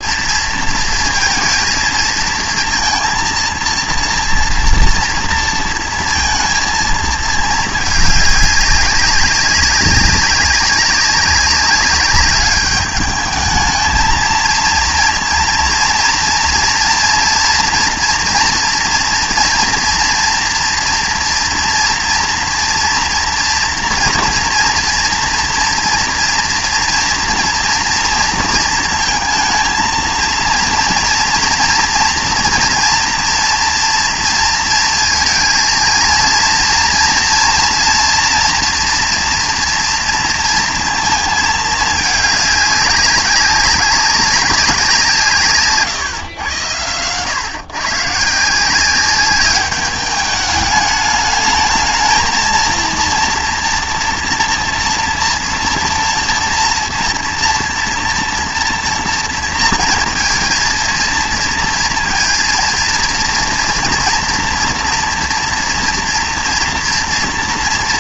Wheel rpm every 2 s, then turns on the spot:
230, 230, 240, 230, 200, 200, 210, 230, 240, 230, 230, 230, 230, 230, 230, 230, 240, 230, 230, 240, 230, 200, 190, 110, 160, 210, 230, 240, 240, 240, 230, 230, 230, 230.
none